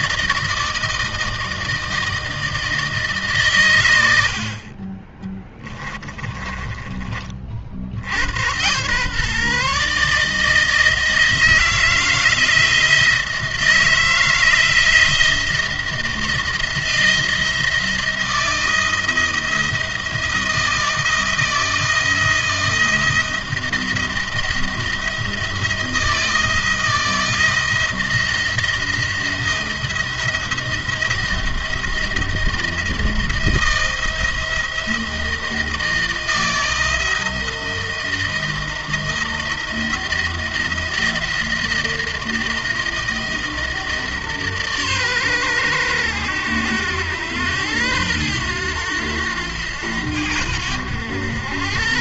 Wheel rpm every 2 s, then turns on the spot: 160, 150, 40, 40, 120, 160, 170, 170, 170, 170, 160, 170, 170, 160, 170, 170, 160, 170, 160, 170, 170, 160, 120, 100, 100, 90.
4-8